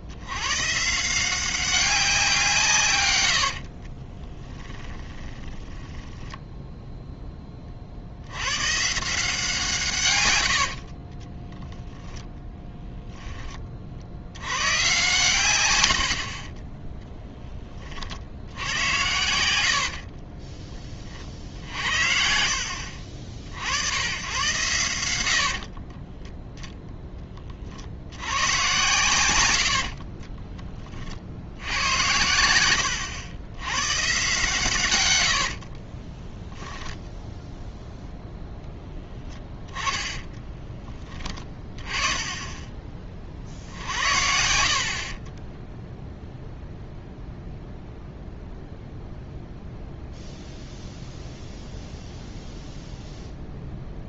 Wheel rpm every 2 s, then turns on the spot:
140, 150, 20, 0, 140, 60, 10, 120, 20, 80, 30, 60, 100, 0, 120, 30, 90, 130, 10, 0, 20, 20, 50, 0, 0, 0, 0.
4-6 10-12 16-18 32-34 44-46